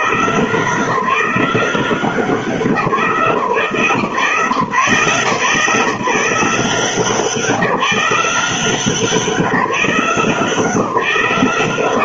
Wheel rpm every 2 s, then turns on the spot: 170, 180, 140, 170, 180, 170.
none